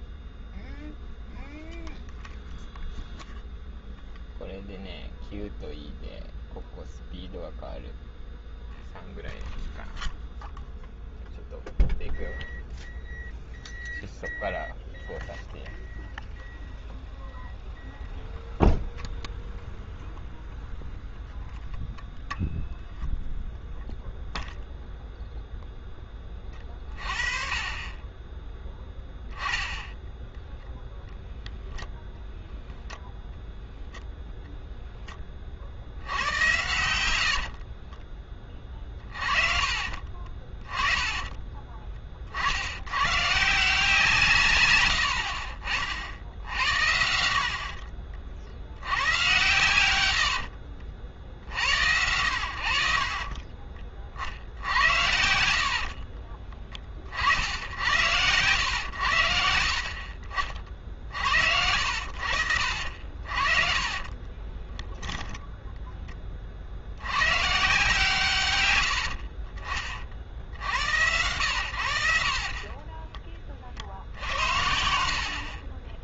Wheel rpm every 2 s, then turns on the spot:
0, 0, 0, 0, 0, 0, 0, 0, 0, 0, 0, 0, 0, 30, 10, 0, 10, 0, 90, 30, 20, 100, 90, 90, 70, 60, 60, 80, 20, 100, 40, 60, 10, 50, 110, 80, 20, 80.
36-38 44-46 50-52 62-66